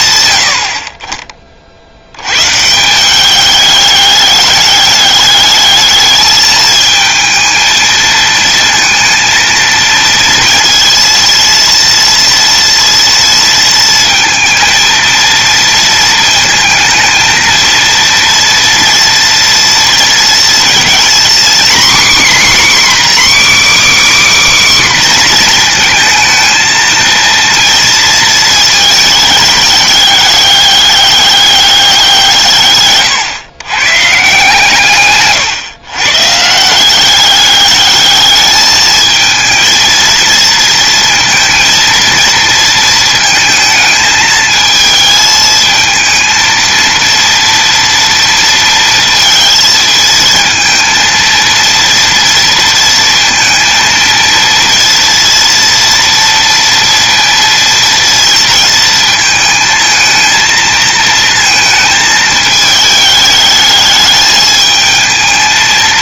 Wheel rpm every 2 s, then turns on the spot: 60, 190, 210, 220, 220, 230, 230, 230, 230, 240, 250, 300, 250, 230, 220, 200, 130, 130, 200, 220, 230, 220, 220, 230, 230, 230, 230, 230, 230, 230, 220, 210, 220.
none